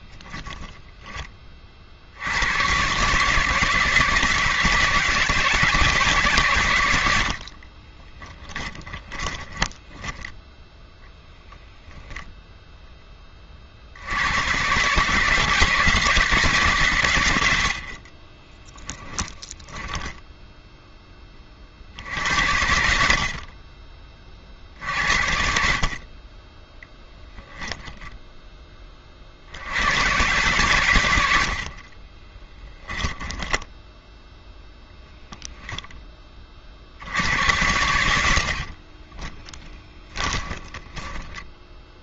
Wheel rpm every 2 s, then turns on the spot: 0, 110, 160, 110, 10, 10, 0, 120, 150, 30, 0, 80, 60, 10, 20, 110, 10, 0, 50, 50, 10.
8-10 18-20 32-34 38-42